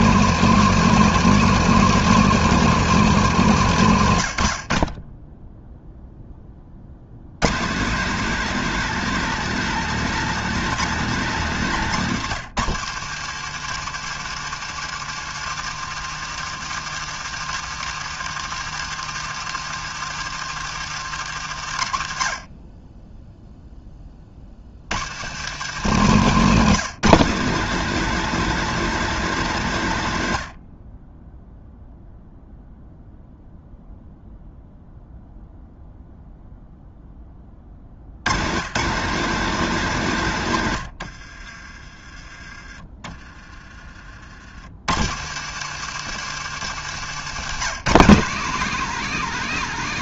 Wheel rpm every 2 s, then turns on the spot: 230, 220, 50, 50, 220, 210, 150, 160, 160, 160, 150, 20, 80, 190, 220, 50, 0, 0, 0, 170, 100, 30, 90, 150, 190.
40-42 46-48